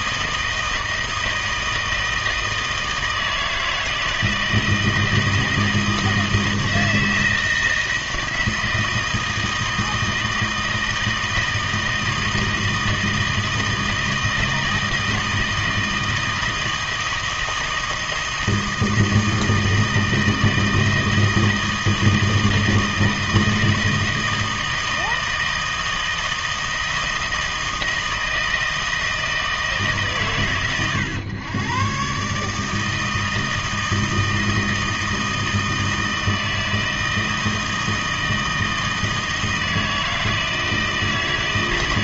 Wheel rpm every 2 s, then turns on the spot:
160, 160, 160, 160, 160, 160, 160, 160, 160, 160, 160, 160, 160, 160, 160, 100, 150, 160, 160, 160, 160.
none